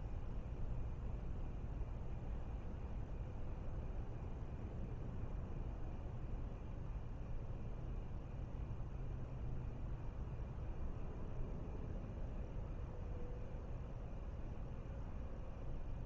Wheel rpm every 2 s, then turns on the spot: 0, 0, 0, 0, 0, 0, 0, 0.
none